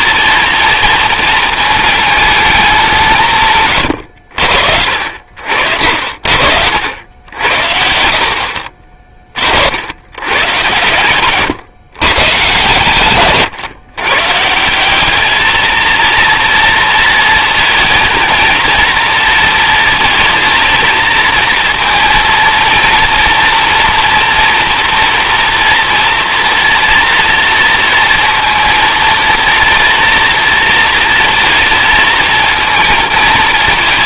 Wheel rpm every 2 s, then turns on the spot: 230, 210, 70, 70, 60, 120, 130, 150, 230, 230, 230, 230, 230, 230, 230, 230, 220.
none